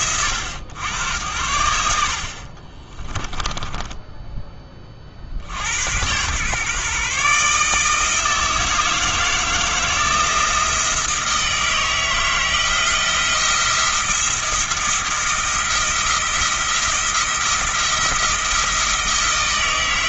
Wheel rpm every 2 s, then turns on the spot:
100, 30, 30, 140, 160, 160, 170, 170, 170, 160.
2-4